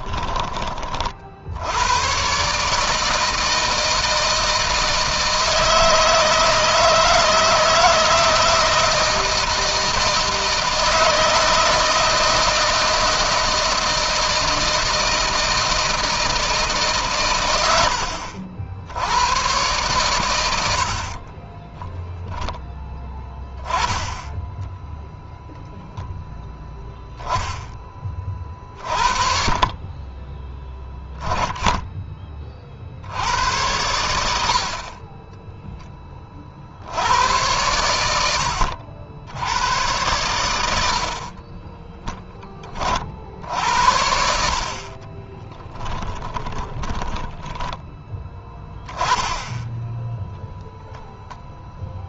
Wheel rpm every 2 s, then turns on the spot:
40, 150, 160, 160, 160, 160, 160, 160, 140, 80, 60, 10, 0, 0, 40, 10, 50, 20, 80, 70, 80, 30, 30, 10, 10, 0.
20-22 44-48